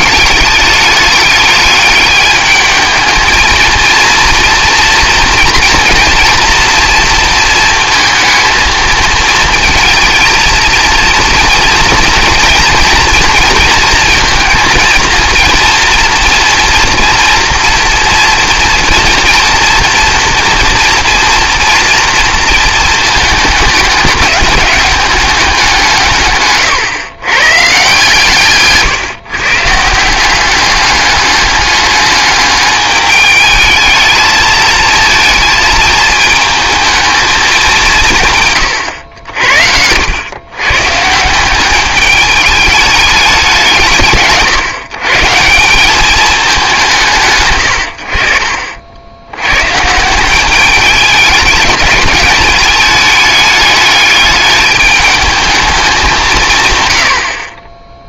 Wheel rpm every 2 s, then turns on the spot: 210, 220, 230, 230, 220, 230, 240, 230, 230, 230, 230, 230, 200, 130, 150, 200, 210, 220, 220, 120, 130, 210, 140, 170, 70, 200, 210, 210, 130.
none